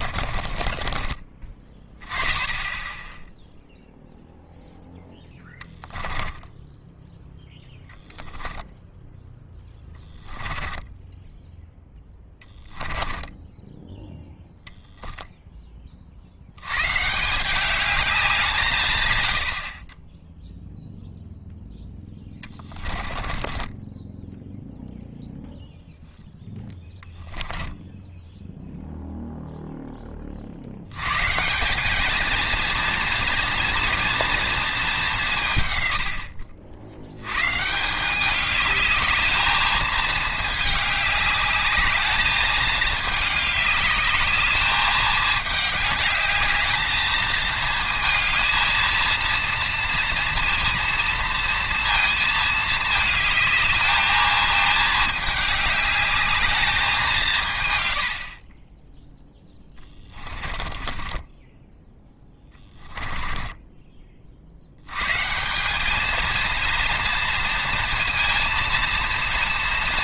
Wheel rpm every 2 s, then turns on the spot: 40, 10, 0, 10, 10, 10, 10, 0, 110, 150, 0, 20, 0, 0, 0, 70, 230, 220, 70, 210, 210, 210, 220, 210, 220, 230, 220, 220, 210, 20, 20, 10, 100, 230, 230.
0-2 6-14 22-24 60-64